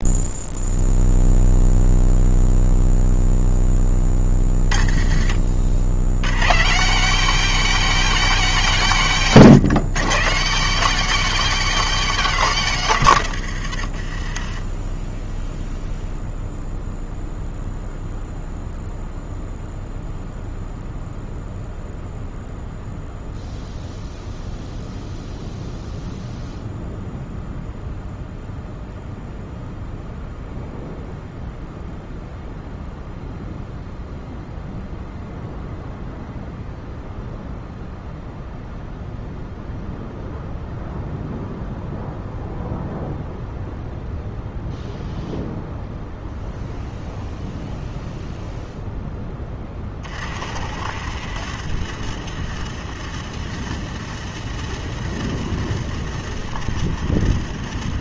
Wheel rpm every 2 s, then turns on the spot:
0, 0, 50, 200, 160, 220, 130, 10, 0, 0, 0, 0, 0, 0, 0, 0, 0, 0, 0, 0, 0, 0, 0, 0, 10, 60, 60, 60, 60.
4-6